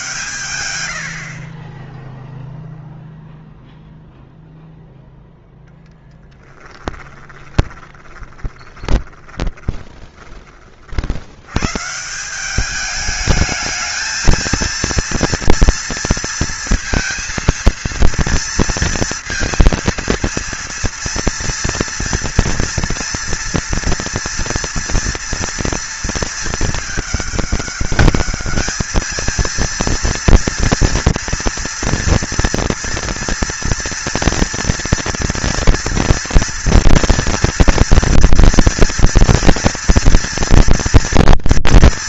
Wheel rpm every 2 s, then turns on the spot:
0, 0, 10, 10, 40, 200, 230, 230, 230, 230, 230, 230, 220, 210, 240, 230, 230, 230, 230, 230, 240.
4-8